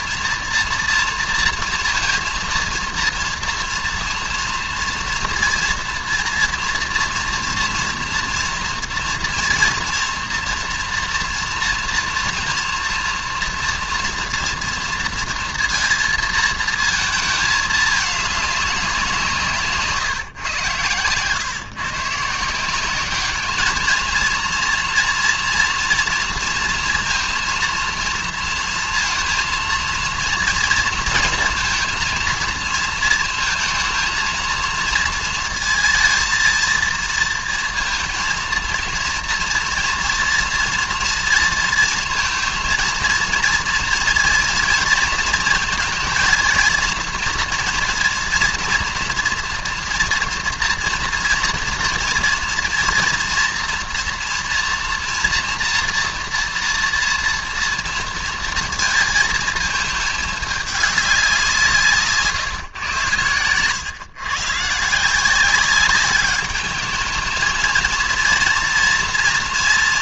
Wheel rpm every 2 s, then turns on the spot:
230, 230, 230, 240, 230, 240, 230, 230, 230, 200, 120, 170, 230, 230, 230, 230, 230, 230, 230, 230, 230, 230, 240, 230, 230, 230, 230, 230, 240, 230, 210, 140, 140, 210, 230.
none